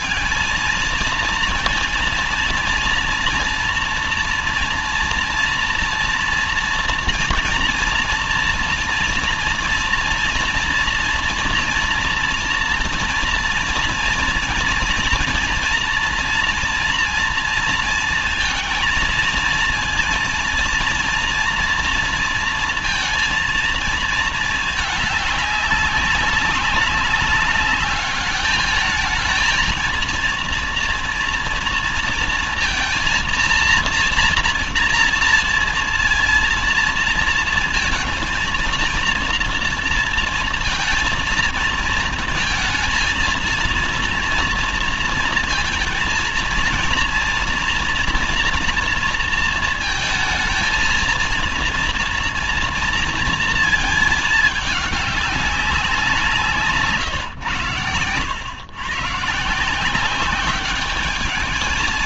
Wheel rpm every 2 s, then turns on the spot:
220, 230, 230, 230, 230, 230, 230, 240, 230, 230, 230, 230, 220, 200, 210, 230, 230, 240, 230, 230, 230, 230, 230, 230, 230, 230, 230, 210, 160, 110, 200.
none